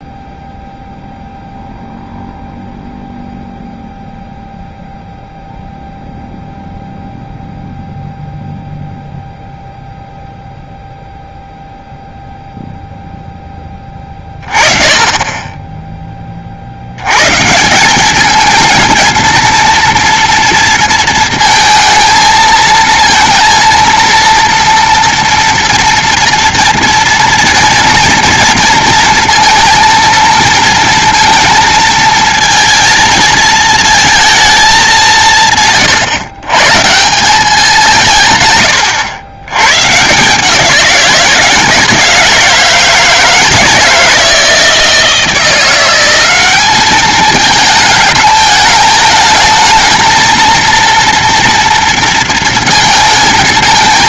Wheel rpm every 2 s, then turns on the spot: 0, 0, 0, 0, 0, 0, 0, 30, 60, 220, 230, 220, 230, 230, 230, 230, 220, 220, 130, 130, 170, 160, 160, 200, 210, 230, 230.
none